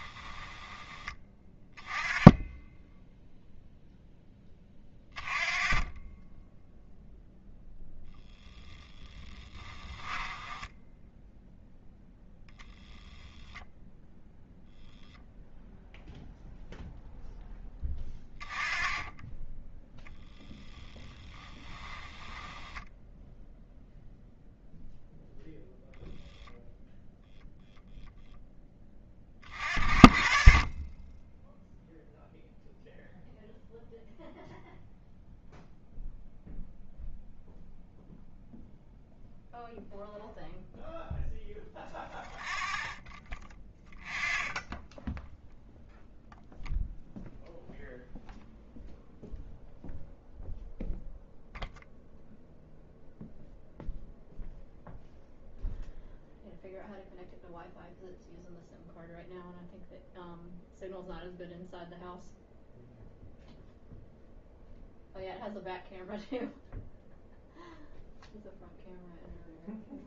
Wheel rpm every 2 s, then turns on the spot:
20, 0, 20, 0, 10, 10, 10, 0, 0, 20, 10, 10, 0, 0, 10, 30, 0, 0, 0, 0, 0, 0, 0, 0, 0, 0, 0, 0, 0, 0, 0, 0, 0, 0, 0.
8-10 22-24